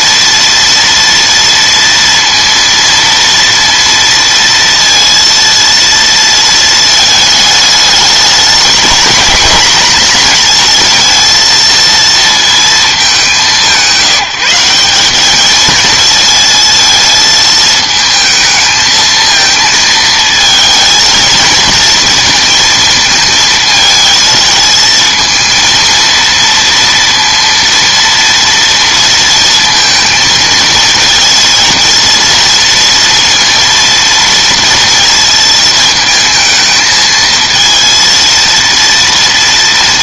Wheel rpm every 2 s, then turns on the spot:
230, 230, 230, 230, 220, 230, 220, 180, 220, 220, 220, 230, 220, 230, 230, 230, 230, 230, 220, 230.
none